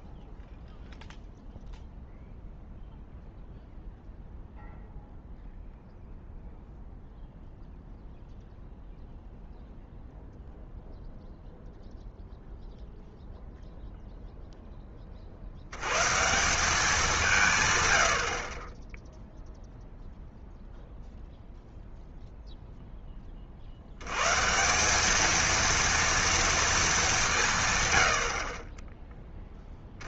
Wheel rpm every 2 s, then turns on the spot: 0, 0, 0, 0, 0, 0, 0, 10, 190, 30, 0, 0, 160, 230, 40.
none